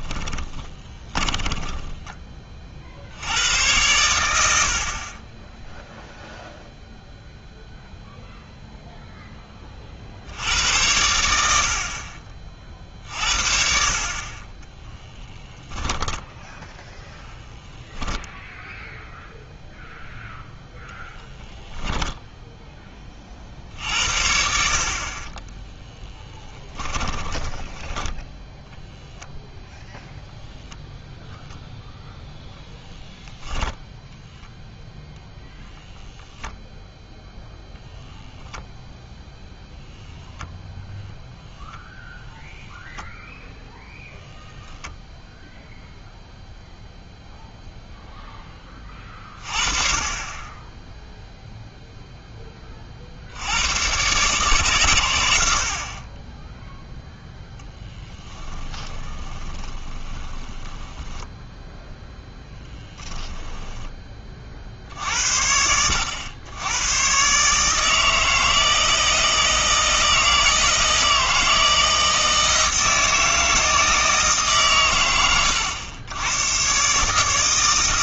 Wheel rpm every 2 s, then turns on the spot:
20, 30, 70, 0, 0, 90, 40, 10, 0, 0, 0, 10, 60, 20, 0, 0, 0, 10, 0, 0, 0, 0, 0, 0, 20, 10, 20, 130, 0, 20, 20, 10, 50, 100, 160, 160, 160, 130, 130.
0-2 14-16 26-28 58-64